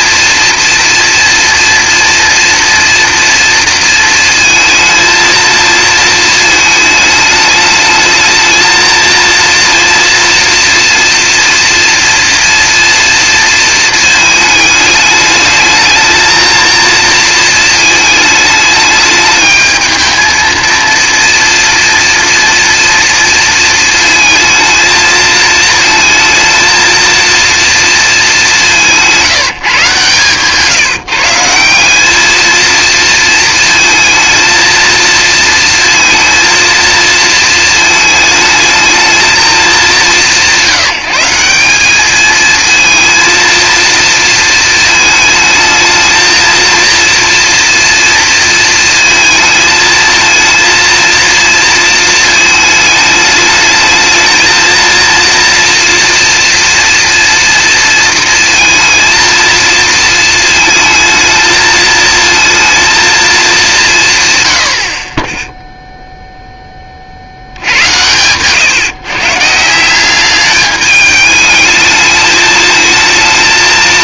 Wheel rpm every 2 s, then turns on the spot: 240, 230, 230, 220, 230, 230, 230, 210, 230, 210, 230, 230, 220, 230, 180, 160, 230, 230, 230, 220, 160, 220, 230, 230, 230, 230, 220, 220, 230, 230, 230, 230, 70, 20, 130, 210, 220.
none